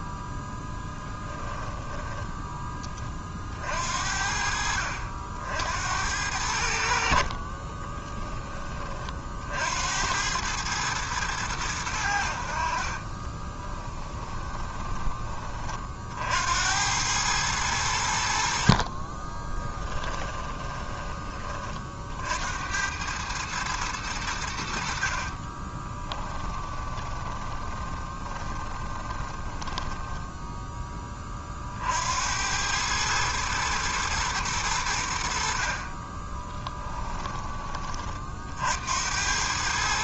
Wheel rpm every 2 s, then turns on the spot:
10, 10, 50, 70, 30, 100, 40, 20, 80, 50, 20, 80, 80, 20, 20, 10, 100, 100, 20, 60.
0-2 12-16 18-22 26-30 36-38